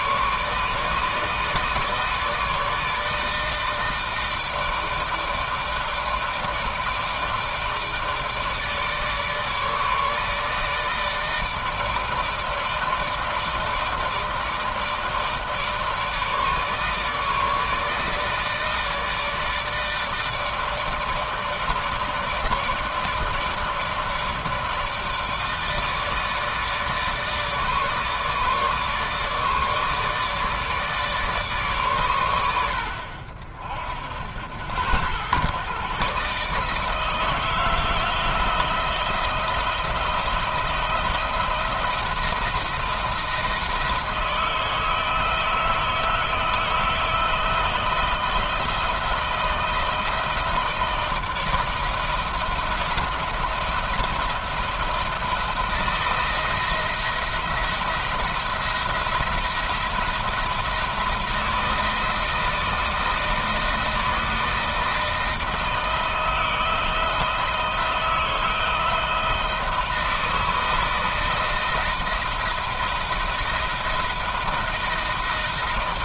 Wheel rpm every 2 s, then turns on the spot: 150, 160, 160, 160, 160, 160, 160, 160, 160, 160, 160, 160, 160, 160, 150, 150, 70, 80, 150, 160, 160, 170, 160, 160, 170, 160, 170, 170, 170, 170, 160, 160, 160, 160, 160, 160, 160, 170.
none